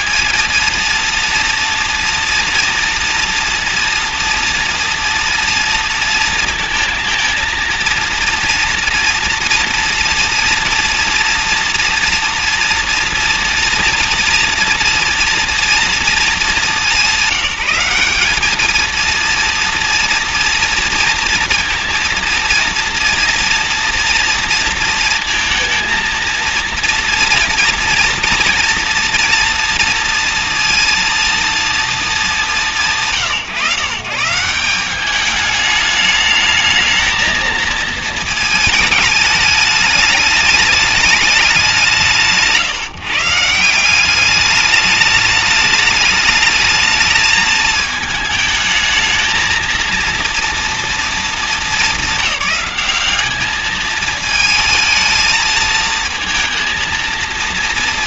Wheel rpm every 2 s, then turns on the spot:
230, 240, 230, 220, 230, 230, 230, 240, 200, 220, 230, 230, 230, 230, 240, 230, 180, 190, 220, 220, 210, 140, 210, 220, 220, 230, 200, 220, 230.
none